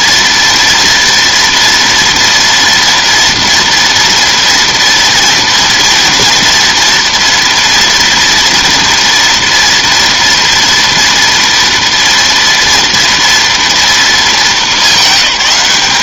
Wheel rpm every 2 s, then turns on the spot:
230, 240, 230, 230, 230, 230, 230, 210.
none